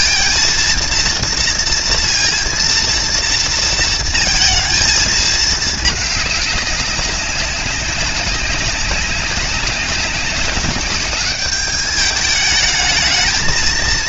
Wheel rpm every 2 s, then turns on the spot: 230, 230, 220, 200, 190, 200, 220.
none